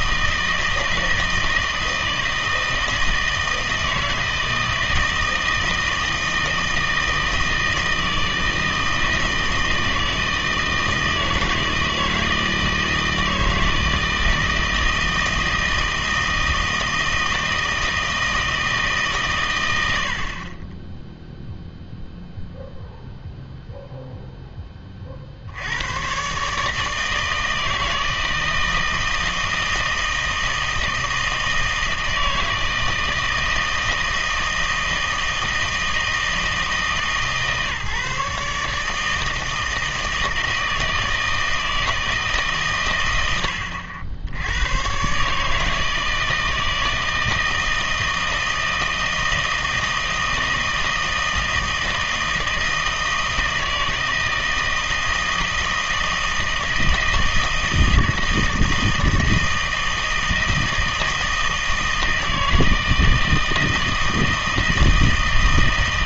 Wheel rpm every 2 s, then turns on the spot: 160, 160, 160, 160, 160, 160, 160, 160, 160, 160, 20, 0, 30, 160, 160, 160, 160, 160, 160, 160, 160, 130, 100, 160, 160, 160, 160, 160, 160, 160, 160, 160, 160.
none